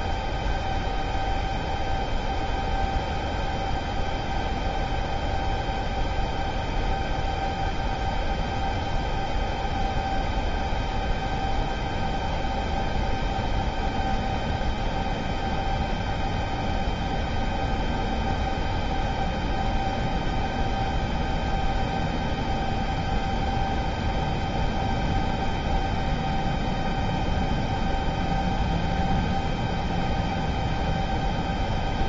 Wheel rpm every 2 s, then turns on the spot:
0, 0, 0, 0, 0, 0, 0, 0, 0, 0, 0, 0, 0, 0, 0, 0.
none